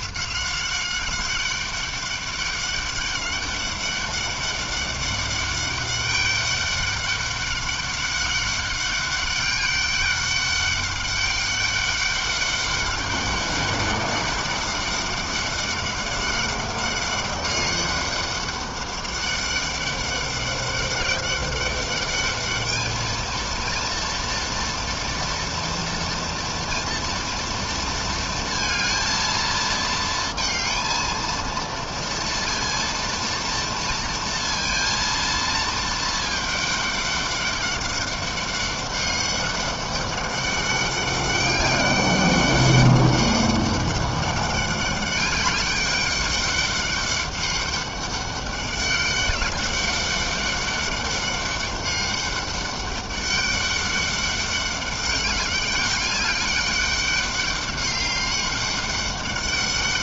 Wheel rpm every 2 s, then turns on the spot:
190, 200, 200, 200, 200, 200, 200, 200, 200, 200, 200, 220, 230, 230, 220, 230, 230, 230, 200, 200, 200, 200, 200, 200, 200, 200, 200, 200, 200, 200.
none